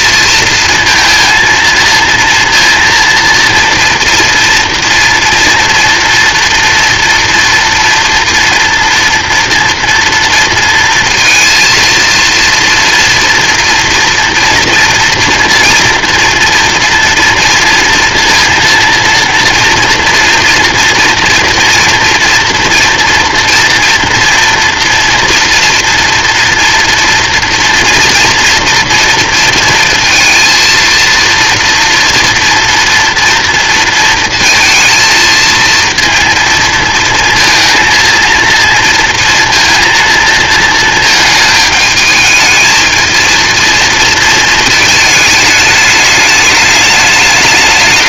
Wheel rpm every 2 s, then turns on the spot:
230, 230, 230, 230, 230, 230, 230, 230, 230, 230, 230, 230, 240, 240, 230, 230, 230, 230, 230, 230, 220, 220, 220, 210.
none